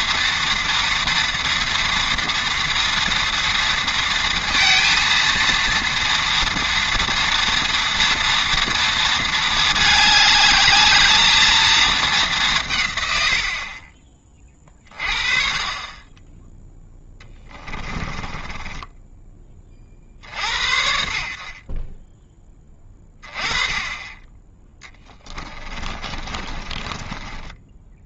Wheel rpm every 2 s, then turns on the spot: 230, 230, 230, 230, 230, 210, 180, 30, 10, 20, 40, 20, 20, 20.
18-20 24-28